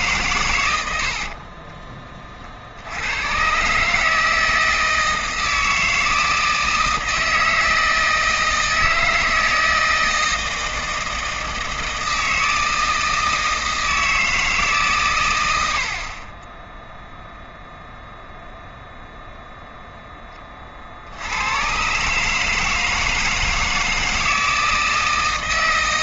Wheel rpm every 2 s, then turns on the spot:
110, 50, 160, 160, 160, 160, 160, 150, 10, 0, 30, 160, 160.
none